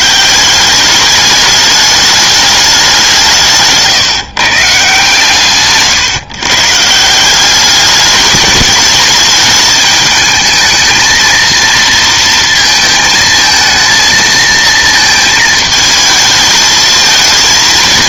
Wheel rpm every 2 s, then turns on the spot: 190, 200, 140, 140, 220, 220, 230, 220, 220.
none